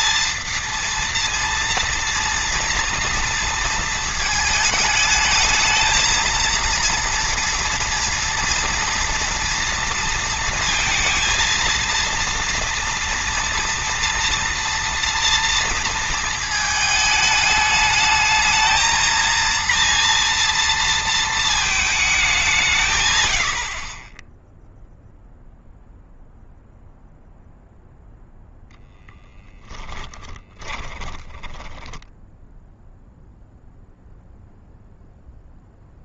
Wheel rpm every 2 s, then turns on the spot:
230, 230, 220, 230, 230, 230, 230, 230, 220, 220, 230, 120, 0, 0, 0, 20, 0, 0.
30-32